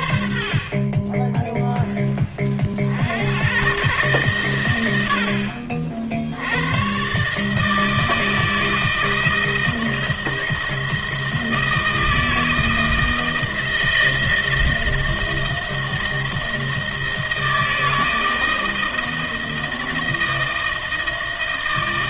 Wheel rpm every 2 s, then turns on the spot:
60, 40, 110, 90, 160, 160, 160, 160, 160, 160, 160.
none